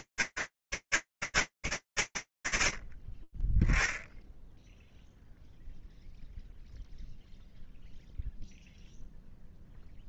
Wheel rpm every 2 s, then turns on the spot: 30, 0, 0, 0, 0.
none